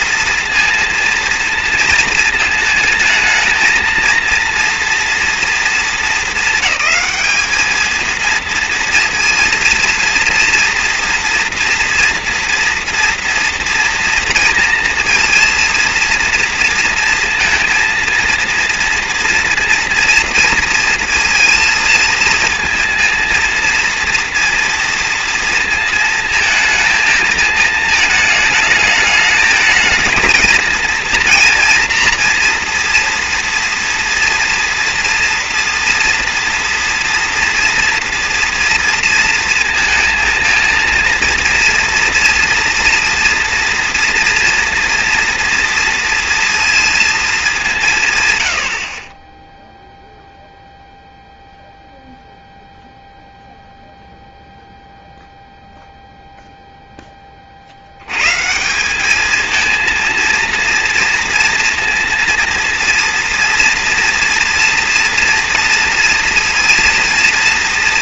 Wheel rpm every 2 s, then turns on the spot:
230, 230, 230, 210, 230, 230, 240, 230, 230, 230, 230, 230, 230, 230, 220, 220, 240, 230, 230, 240, 230, 230, 230, 230, 100, 0, 0, 0, 0, 150, 230, 230, 230, 230.
none